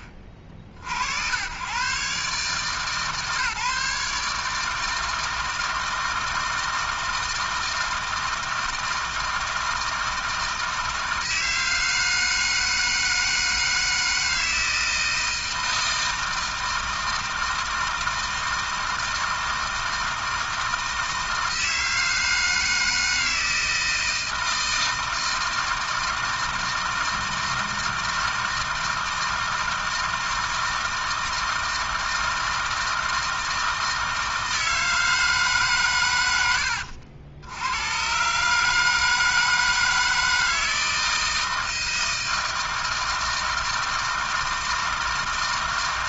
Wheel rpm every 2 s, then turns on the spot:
60, 150, 160, 160, 160, 160, 160, 160, 160, 160, 160, 160, 160, 160, 160, 160, 160, 160, 80, 160, 160, 160, 160.
none